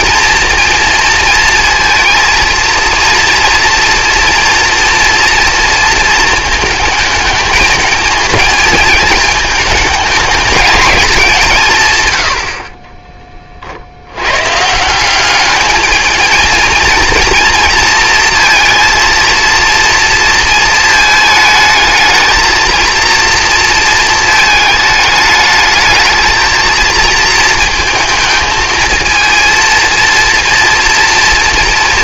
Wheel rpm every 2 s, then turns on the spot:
230, 230, 230, 220, 220, 220, 50, 160, 230, 230, 230, 220, 220, 220, 220, 230.
none